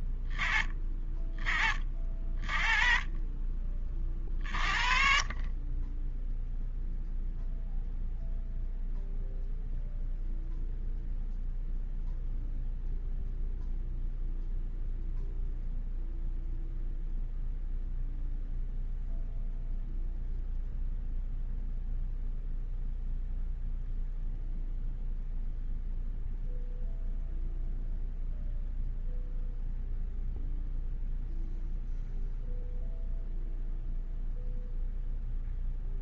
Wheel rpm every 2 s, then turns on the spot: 20, 30, 40, 0, 0, 0, 0, 0, 0, 0, 0, 0, 0, 0, 0, 0, 0, 0.
none